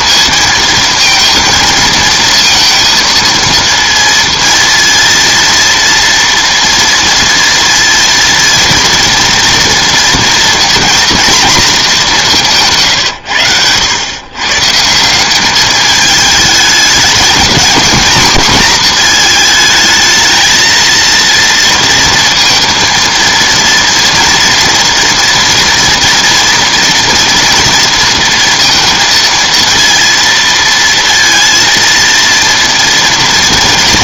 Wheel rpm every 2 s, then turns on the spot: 230, 230, 230, 230, 230, 240, 150, 160, 220, 230, 230, 230, 230, 230, 230, 230, 230.
none